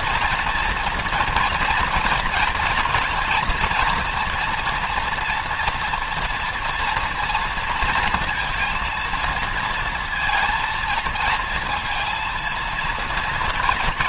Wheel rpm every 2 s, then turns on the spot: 230, 230, 240, 230, 230, 230, 230.
none